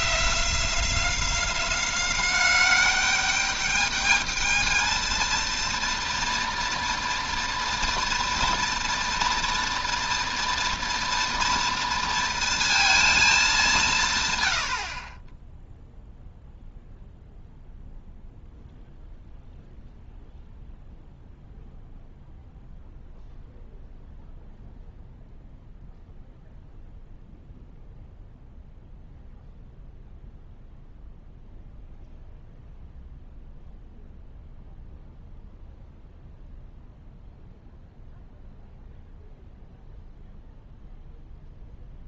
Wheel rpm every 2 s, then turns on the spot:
180, 190, 220, 230, 230, 230, 230, 90, 0, 0, 0, 0, 0, 0, 0, 0, 0, 0, 0, 0, 0.
none